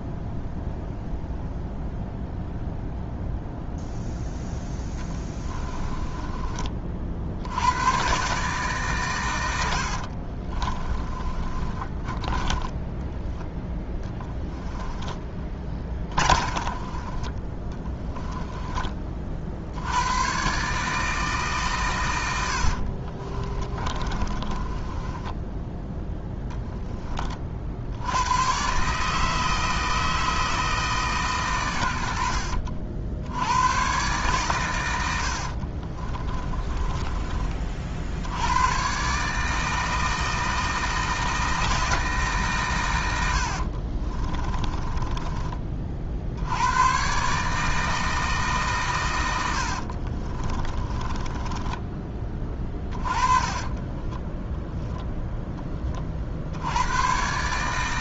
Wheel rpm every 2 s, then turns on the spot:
0, 0, 10, 40, 130, 30, 10, 10, 30, 20, 150, 50, 20, 20, 140, 160, 60, 110, 20, 110, 160, 110, 20, 110, 130, 20, 30, 0, 90.
4-6 10-18 22-28 36-38 44-46 50-54